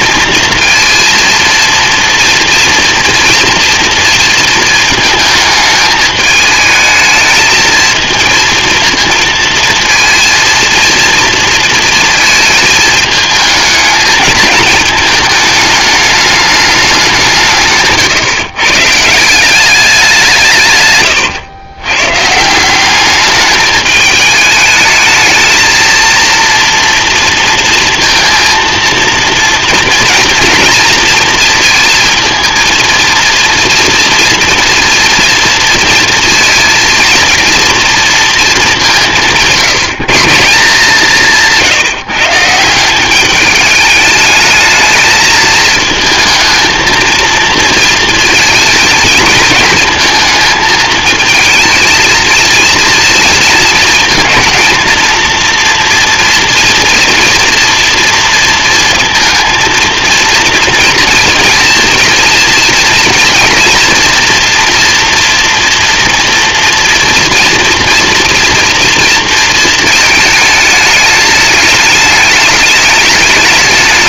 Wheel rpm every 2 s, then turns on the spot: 230, 240, 220, 210, 230, 220, 220, 220, 210, 140, 150, 170, 210, 230, 230, 230, 230, 230, 230, 210, 160, 160, 220, 220, 230, 220, 230, 230, 230, 230, 230, 230, 240, 230, 230, 220, 220.
none